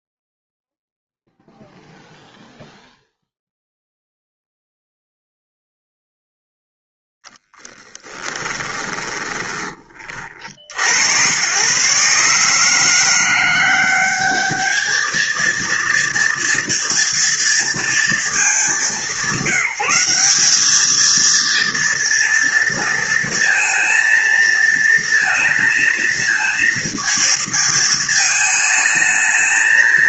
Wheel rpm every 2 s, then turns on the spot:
0, 0, 0, 0, 20, 60, 160, 210, 230, 200, 210, 230, 230, 230, 220.
8-10